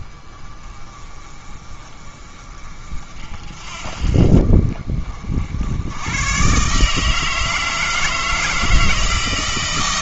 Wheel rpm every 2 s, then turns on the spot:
30, 40, 40, 150, 160.
none